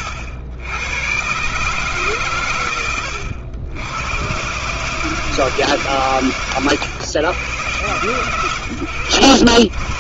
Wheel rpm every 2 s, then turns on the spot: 80, 90, 140, 120, 110.
none